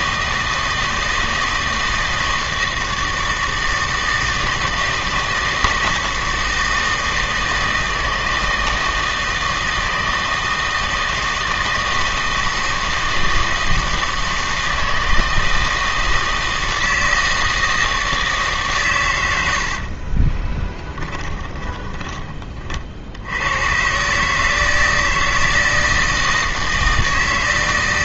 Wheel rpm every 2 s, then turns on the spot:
160, 160, 160, 160, 160, 160, 160, 160, 160, 140, 20, 50, 160, 160.
20-22